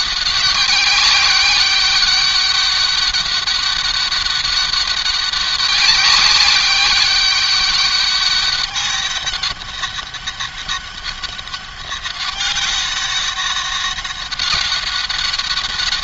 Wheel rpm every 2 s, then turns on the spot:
200, 200, 190, 200, 200, 190, 200, 200.
none